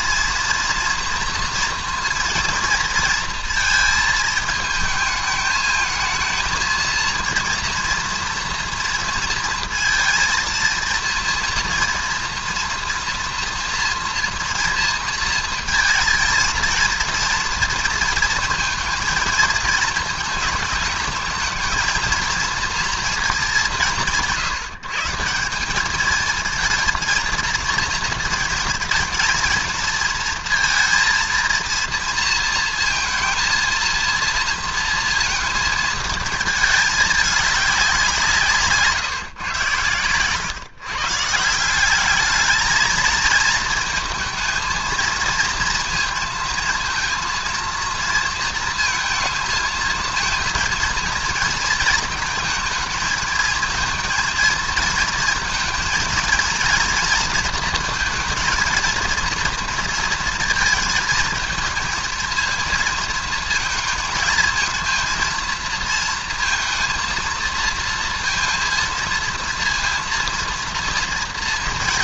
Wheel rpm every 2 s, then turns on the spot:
230, 230, 220, 220, 230, 230, 240, 230, 230, 230, 220, 220, 170, 210, 230, 230, 230, 230, 220, 180, 120, 200, 220, 230, 230, 220, 220, 230, 230, 230, 230, 220, 230, 230, 230, 230.
none